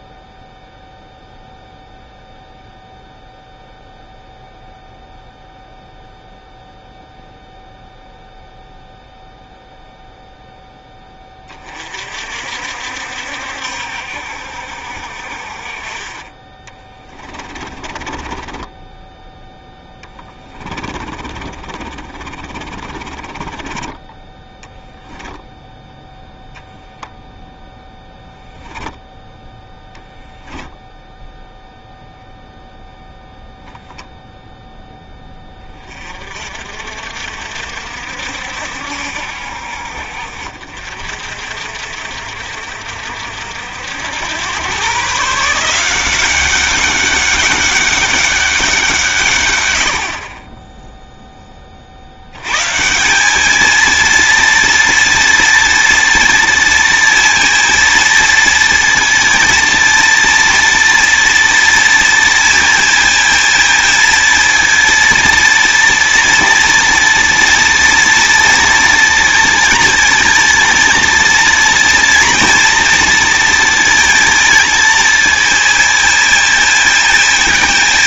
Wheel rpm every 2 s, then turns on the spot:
0, 0, 0, 0, 0, 10, 60, 60, 20, 10, 40, 30, 10, 0, 10, 0, 0, 0, 50, 60, 50, 60, 120, 200, 180, 10, 140, 230, 230, 230, 230, 230, 230, 230, 230, 230, 230, 220, 220.
16-26 28-30